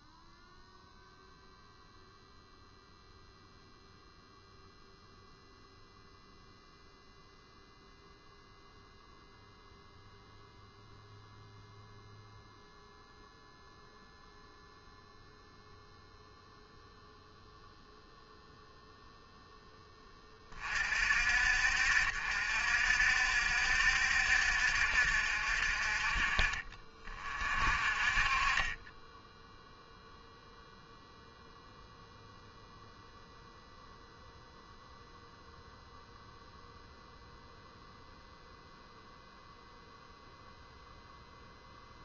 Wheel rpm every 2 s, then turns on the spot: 0, 0, 0, 0, 0, 0, 0, 0, 0, 0, 40, 60, 60, 30, 20, 0, 0, 0, 0, 0, 0.
none